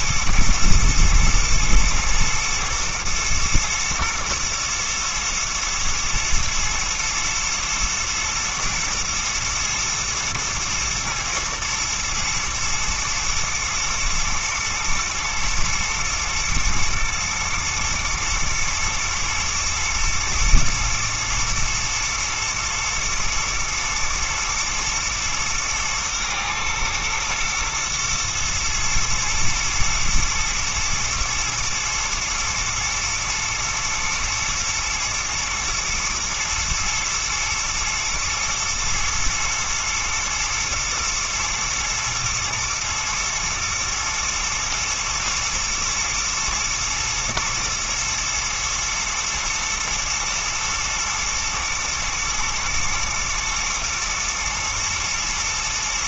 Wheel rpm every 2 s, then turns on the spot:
110, 120, 120, 110, 110, 110, 110, 110, 110, 120, 120, 120, 110, 110, 110, 120, 120, 110, 110, 110, 110, 120, 110, 110, 110, 110, 110, 110.
none